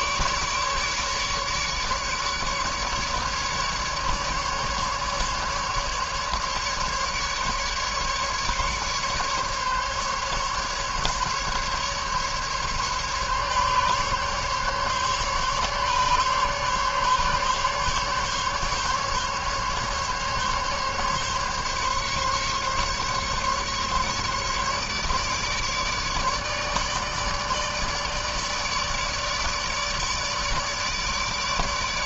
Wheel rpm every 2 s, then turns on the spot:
150, 150, 150, 150, 140, 140, 140, 140, 140, 140, 140, 140, 150, 150, 150, 150.
none